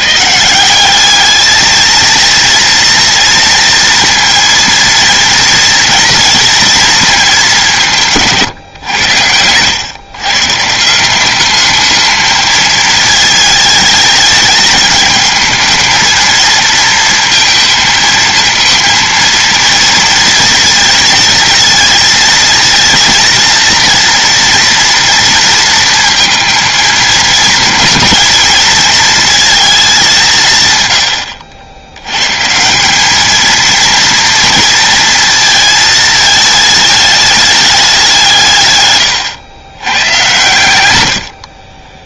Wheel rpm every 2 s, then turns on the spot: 190, 230, 230, 230, 120, 180, 220, 210, 230, 230, 230, 230, 230, 230, 220, 110, 190, 230, 210, 130, 100.
30-32